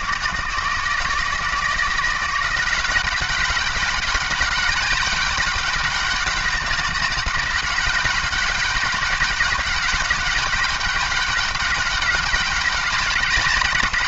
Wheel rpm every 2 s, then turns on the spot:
160, 180, 200, 200, 190, 200, 200.
none